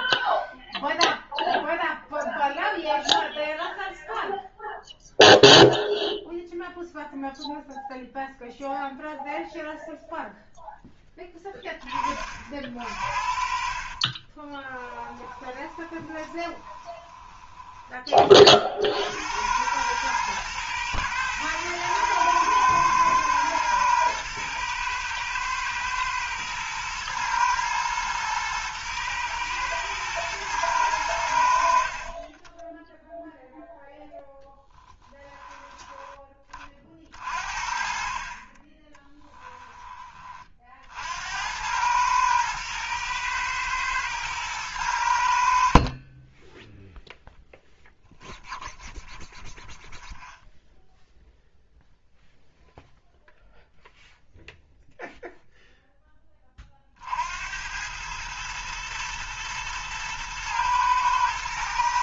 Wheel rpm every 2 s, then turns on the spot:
0, 0, 0, 0, 0, 0, 40, 20, 20, 50, 120, 110, 110, 110, 110, 110, 10, 10, 30, 30, 50, 110, 100, 10, 0, 0, 0, 0, 40, 110, 110.
14-18 32-34